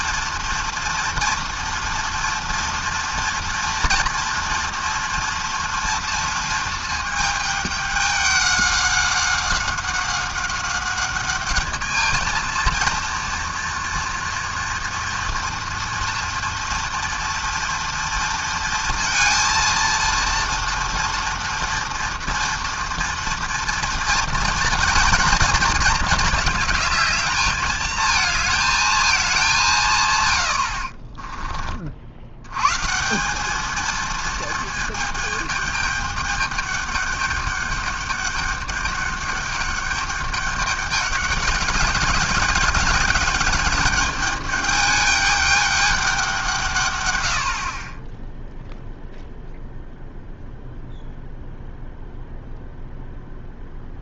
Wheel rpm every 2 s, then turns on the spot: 230, 230, 230, 220, 190, 200, 230, 240, 230, 230, 230, 230, 220, 220, 220, 70, 140, 220, 200, 200, 200, 200, 210, 130, 0, 0, 0.
30-32